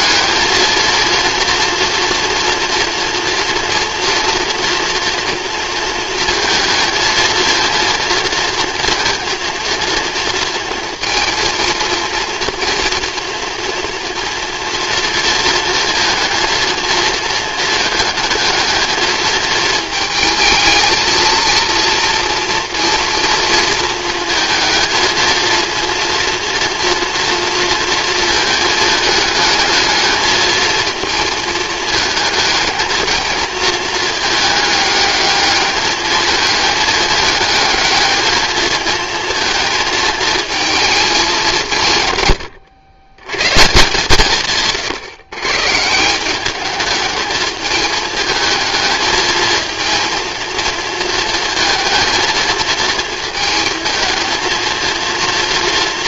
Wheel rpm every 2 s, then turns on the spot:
230, 230, 230, 220, 230, 230, 240, 230, 230, 220, 220, 230, 220, 230, 220, 220, 220, 210, 220, 220, 220, 120, 130, 200, 220, 230, 230, 220.
none